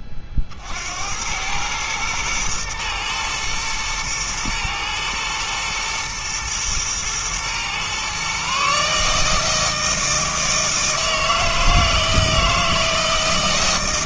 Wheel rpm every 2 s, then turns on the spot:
70, 110, 110, 110, 150, 160, 160.
none